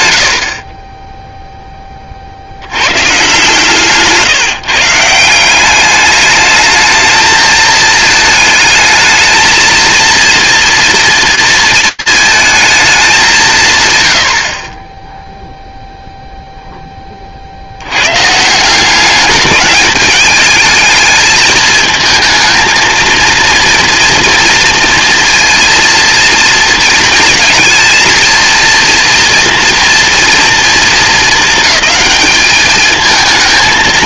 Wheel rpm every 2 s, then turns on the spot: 50, 80, 150, 210, 210, 230, 220, 50, 10, 190, 220, 230, 230, 230, 230, 230, 220.
none